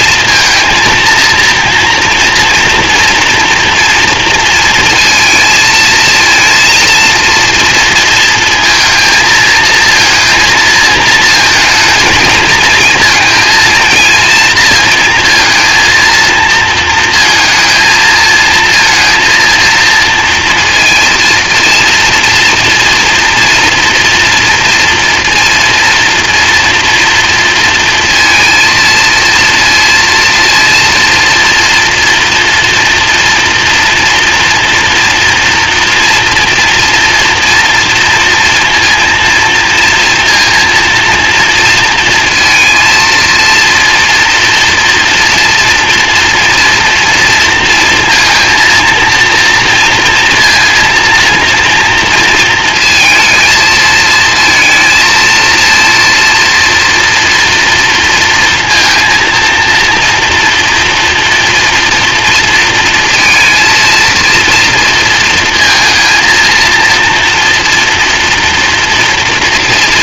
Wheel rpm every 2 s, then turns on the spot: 230, 240, 230, 230, 230, 230, 230, 230, 220, 230, 230, 230, 230, 230, 230, 230, 240, 240, 230, 230, 230, 230, 230, 230, 230, 230, 230, 230, 230, 230, 230, 230, 230, 230, 230.
none